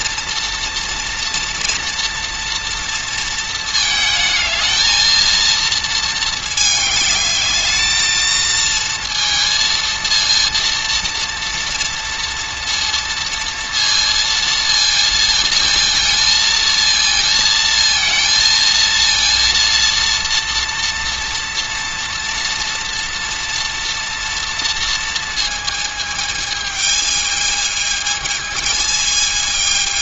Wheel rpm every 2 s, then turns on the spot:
230, 230, 220, 220, 230, 230, 230, 230, 230, 230, 230, 230, 230, 220, 220.
none